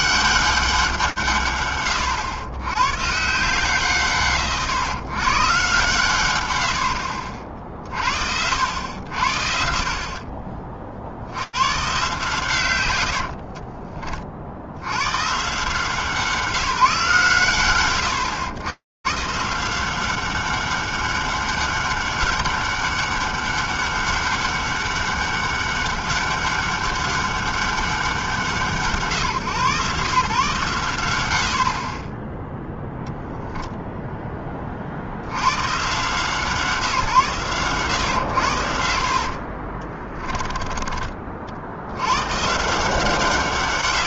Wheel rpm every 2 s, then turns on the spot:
190, 110, 120, 100, 90, 40, 120, 50, 170, 120, 200, 200, 200, 200, 150, 130, 0, 30, 150, 90, 30, 130.
10-12 40-42